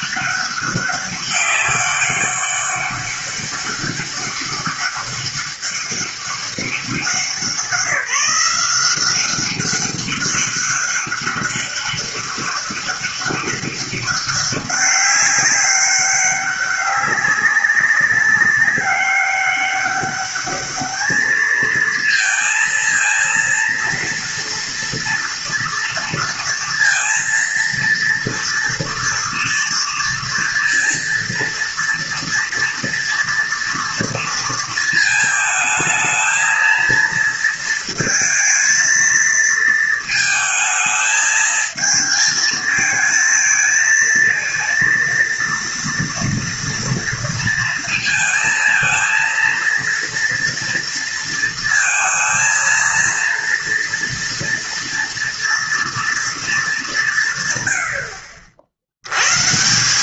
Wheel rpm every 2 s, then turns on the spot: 200, 200, 200, 190, 190, 200, 200, 200, 190, 200, 210, 230, 230, 230, 230, 230, 230, 220, 230, 230, 220, 230, 230, 230, 230, 230, 230, 230, 200, 80.
none